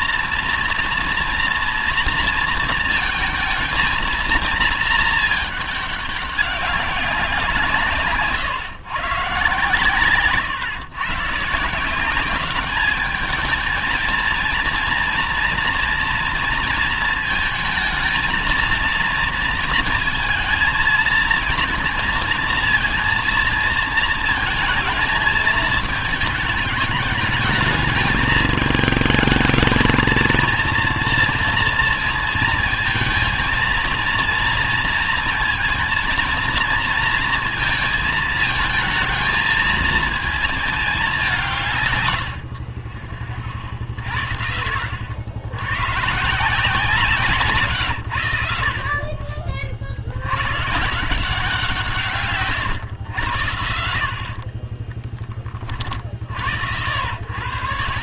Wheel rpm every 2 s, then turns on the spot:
230, 230, 220, 200, 130, 140, 200, 230, 230, 220, 230, 230, 230, 210, 220, 230, 230, 230, 230, 220, 220, 60, 70, 150, 70, 110, 120, 40, 60.
54-56